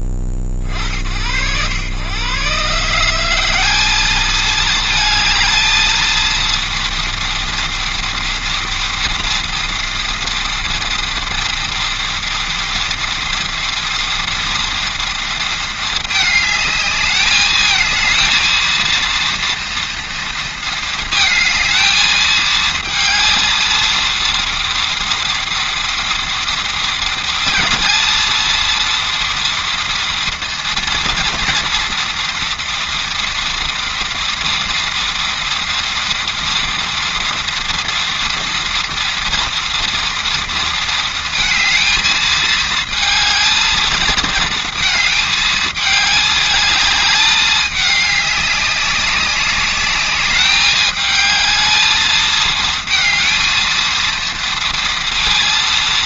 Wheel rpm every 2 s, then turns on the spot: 20, 120, 210, 230, 230, 230, 230, 230, 220, 220, 230, 220, 230, 230, 230, 230, 230, 230, 230, 240, 230, 220, 230, 210, 200, 210, 220, 230.
none